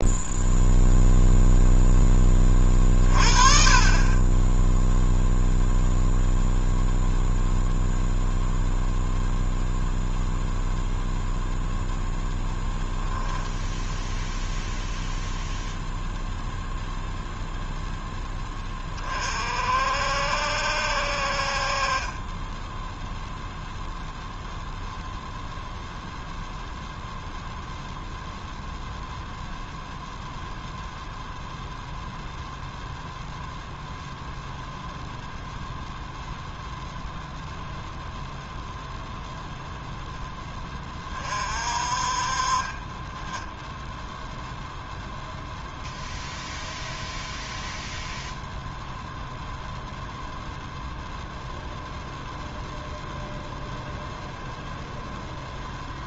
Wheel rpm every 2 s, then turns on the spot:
0, 30, 0, 0, 0, 0, 0, 0, 0, 40, 60, 10, 0, 0, 0, 0, 0, 0, 0, 0, 20, 20, 0, 0, 0, 0, 0, 0.
none